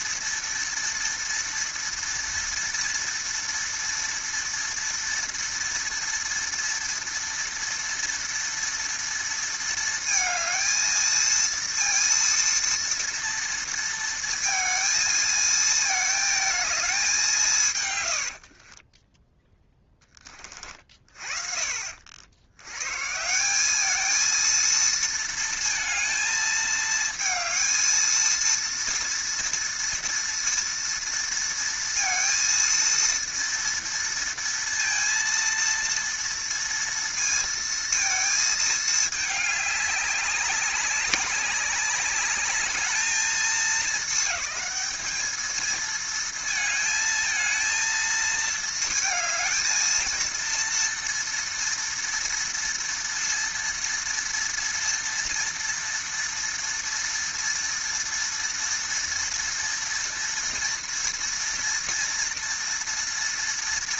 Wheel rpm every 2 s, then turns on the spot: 230, 230, 230, 230, 230, 230, 230, 230, 220, 30, 40, 110, 230, 220, 230, 230, 230, 230, 230, 220, 200, 210, 220, 220, 220, 230, 230, 230, 230, 230, 230, 230.
18-20